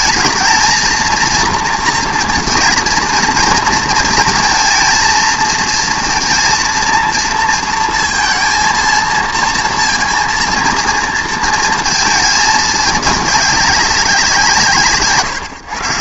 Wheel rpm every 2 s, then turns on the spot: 220, 230, 230, 230, 230, 230, 210, 170.
none